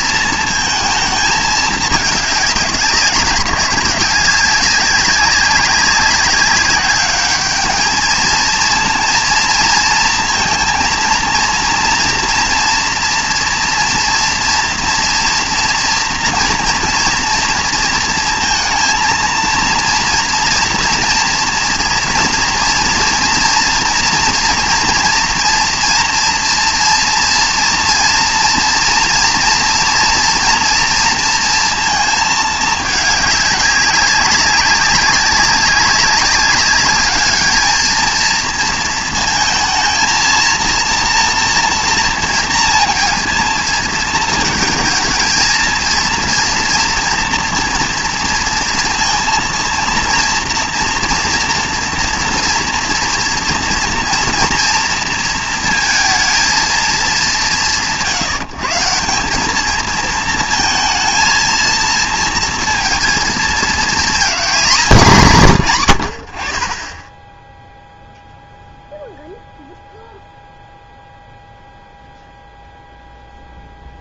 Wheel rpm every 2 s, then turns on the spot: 230, 200, 190, 200, 230, 230, 230, 240, 230, 230, 230, 230, 230, 230, 230, 230, 220, 190, 200, 230, 230, 230, 220, 230, 230, 230, 230, 230, 230, 160, 220, 230, 210, 40, 0, 0, 0.
none